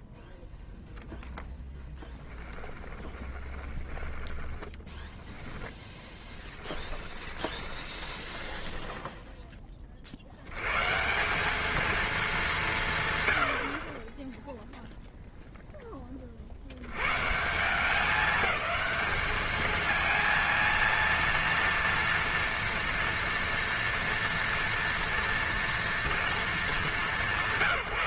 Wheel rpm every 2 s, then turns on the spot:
0, 10, 20, 20, 10, 70, 200, 10, 40, 210, 230, 230, 230, 210.
2-10